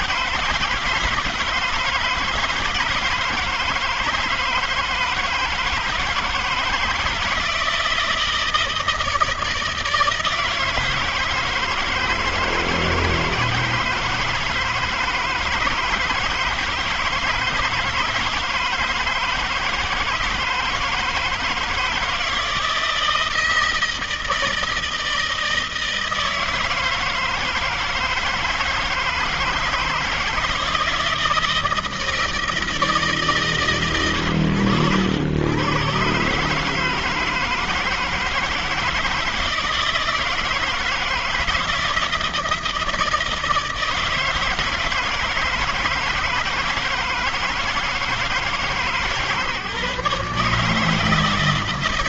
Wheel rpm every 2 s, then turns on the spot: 160, 160, 170, 160, 160, 160, 160, 160, 160, 160, 160, 160, 160, 160, 160, 160, 160, 100, 130, 160, 160, 160, 160, 160, 160, 150.
none